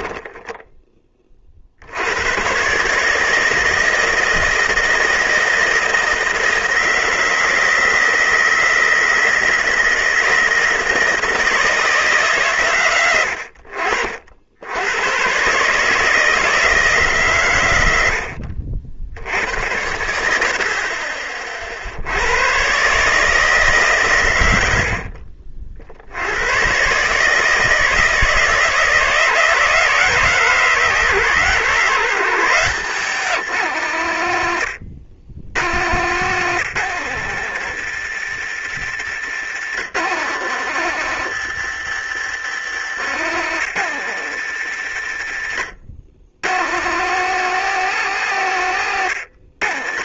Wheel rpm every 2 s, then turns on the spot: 10, 140, 160, 160, 160, 160, 110, 100, 160, 70, 50, 140, 70, 120, 160, 140, 160, 70, 130, 100, 120, 110, 90, 120, 110.
42-44